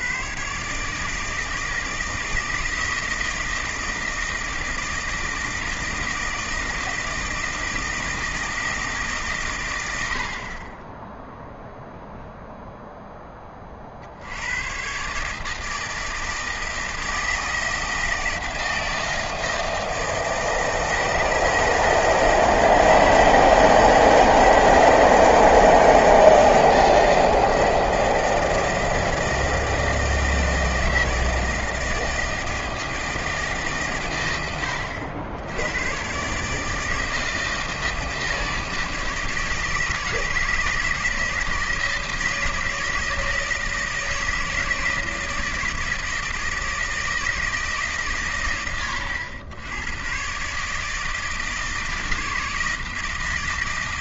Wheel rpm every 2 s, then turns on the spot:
130, 160, 160, 160, 160, 30, 0, 100, 160, 160, 160, 160, 160, 160, 160, 160, 160, 100, 150, 160, 170, 160, 160, 160, 120, 140, 160.
none